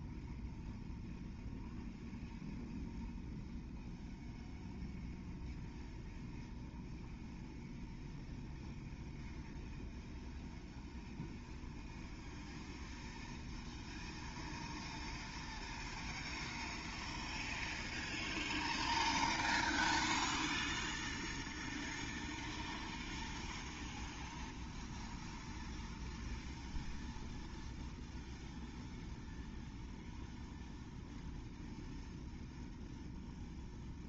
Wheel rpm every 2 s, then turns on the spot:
0, 0, 0, 0, 0, 0, 0, 0, 0, 0, 0, 0, 0, 0, 0, 0, 0.
none